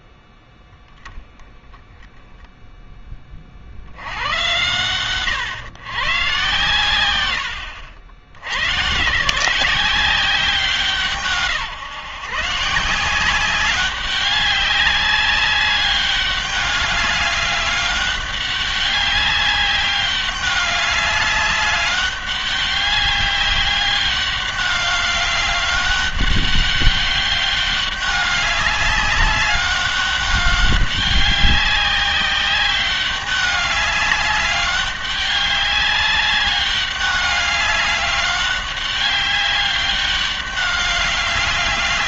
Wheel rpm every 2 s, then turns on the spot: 10, 10, 110, 110, 130, 160, 170, 200, 200, 200, 200, 200, 200, 200, 200, 200, 200, 200, 200, 200, 200.
none